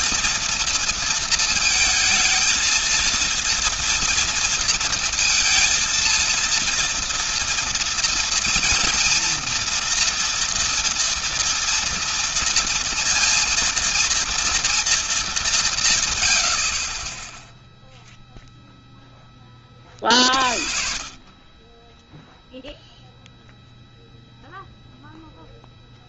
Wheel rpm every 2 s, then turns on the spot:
230, 230, 230, 230, 230, 230, 230, 230, 60, 0, 40, 0, 0.
none